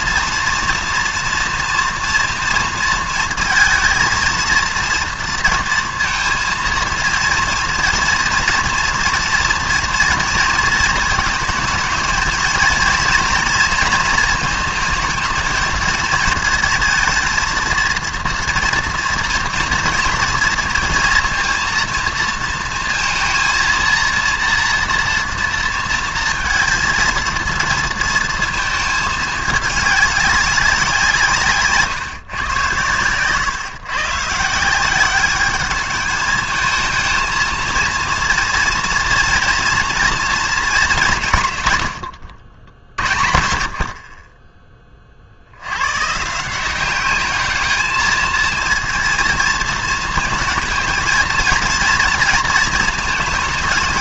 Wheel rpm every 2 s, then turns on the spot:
230, 230, 230, 230, 230, 230, 230, 230, 220, 230, 230, 220, 230, 230, 220, 180, 110, 180, 220, 230, 200, 50, 20, 190, 230, 230, 220.
none